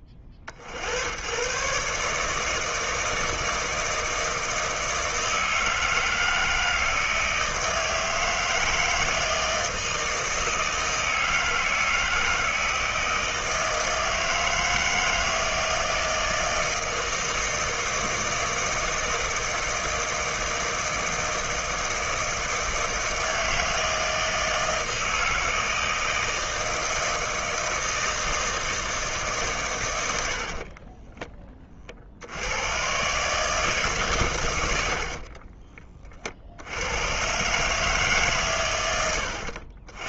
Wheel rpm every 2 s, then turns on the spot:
60, 160, 160, 160, 160, 160, 160, 160, 160, 160, 160, 160, 160, 160, 160, 40, 100, 90, 80, 120.
30-32